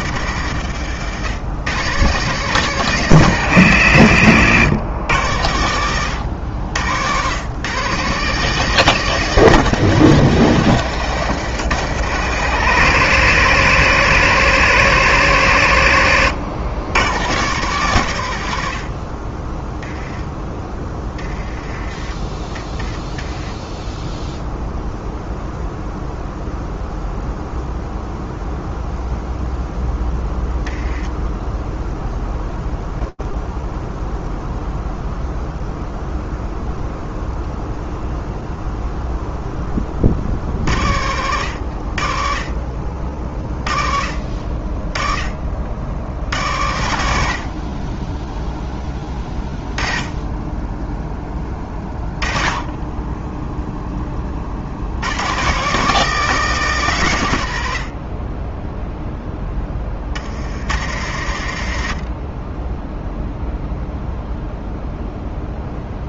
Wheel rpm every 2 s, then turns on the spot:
110, 160, 110, 100, 160, 140, 130, 140, 110, 100, 10, 10, 0, 0, 0, 0, 0, 0, 0, 0, 70, 40, 40, 80, 10, 10, 10, 90, 140, 0, 110, 0, 0.
none